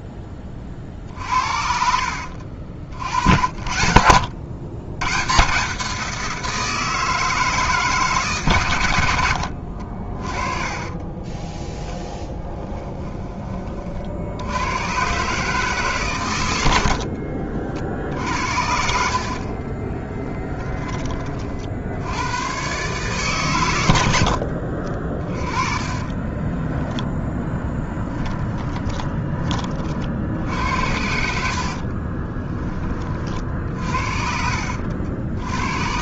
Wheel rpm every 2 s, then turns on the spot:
30, 60, 120, 160, 110, 20, 10, 120, 60, 70, 20, 140, 40, 0, 10, 70, 30, 70.
0-2 10-12